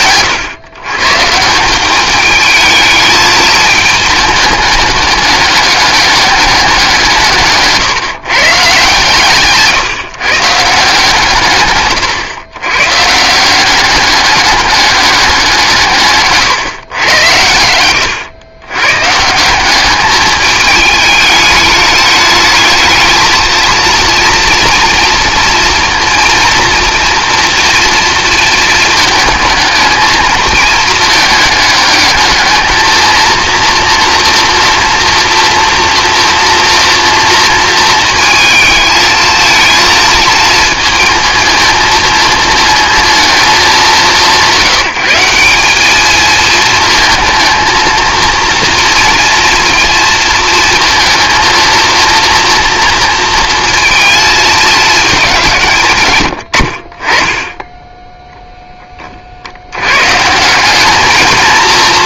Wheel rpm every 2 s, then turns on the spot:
120, 220, 210, 180, 130, 150, 130, 200, 120, 130, 210, 220, 230, 230, 230, 220, 220, 230, 230, 220, 230, 220, 180, 220, 230, 230, 230, 220, 50, 20, 200.
none